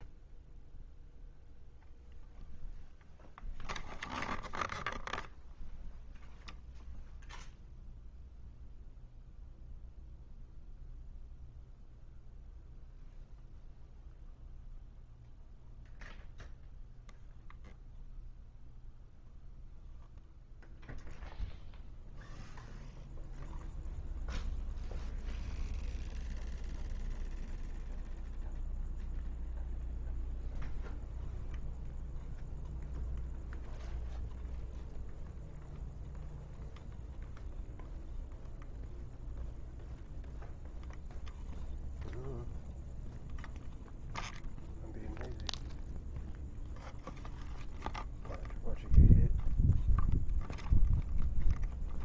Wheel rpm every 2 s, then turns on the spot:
0, 0, 0, 0, 0, 0, 0, 0, 0, 0, 0, 0, 0, 0, 0, 0, 0, 0, 0, 0, 0, 0, 0, 0, 0, 0.
none